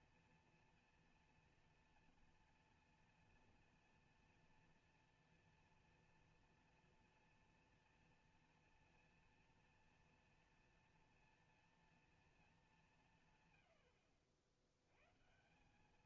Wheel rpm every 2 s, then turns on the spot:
230, 240, 240, 240, 230, 230, 220, 70.
none